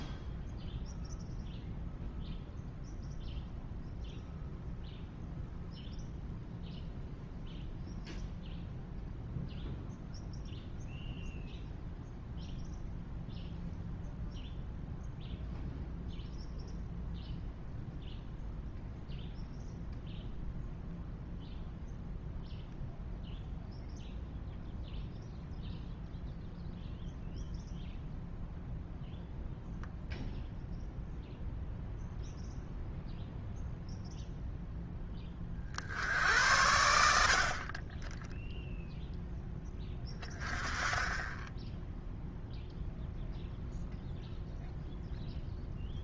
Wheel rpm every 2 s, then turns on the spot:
0, 0, 0, 0, 0, 0, 0, 0, 0, 0, 0, 0, 0, 0, 0, 0, 0, 10, 80, 0, 10, 0, 0.
none